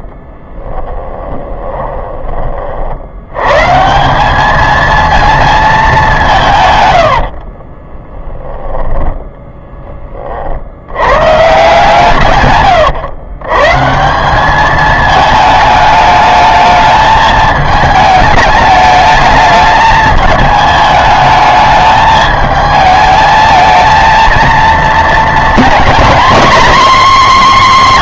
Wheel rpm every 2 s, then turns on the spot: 20, 50, 220, 130, 20, 70, 130, 210, 210, 210, 210, 220, 230, 250.
0-2 8-10